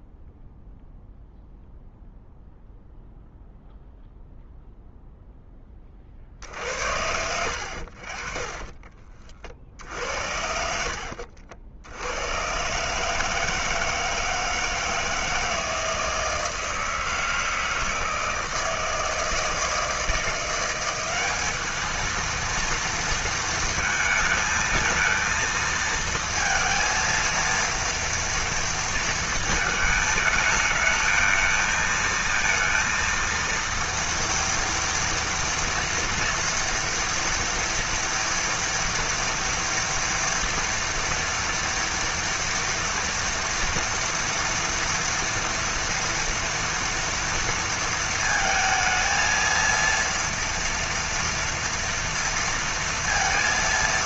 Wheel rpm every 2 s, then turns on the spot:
0, 0, 0, 70, 30, 70, 140, 160, 160, 160, 180, 230, 220, 230, 230, 220, 230, 230, 230, 230, 230, 230, 240, 230, 220, 230, 230.
8-10